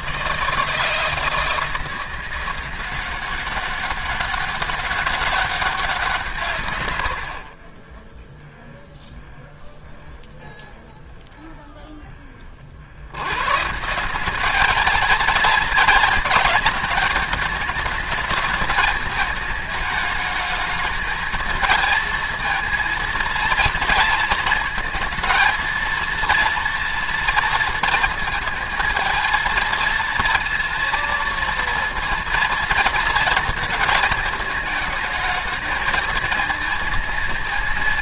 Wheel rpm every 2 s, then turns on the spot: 160, 180, 190, 130, 0, 0, 50, 210, 210, 220, 220, 230, 220, 230, 230, 230, 230, 220, 230.
none